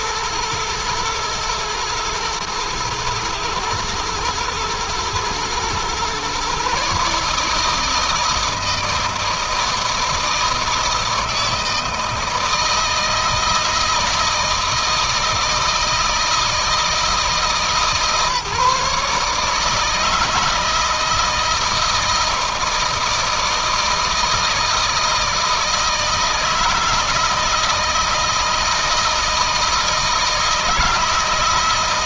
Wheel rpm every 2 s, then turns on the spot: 120, 110, 110, 130, 160, 160, 160, 160, 160, 150, 160, 160, 160, 160, 160, 160.
none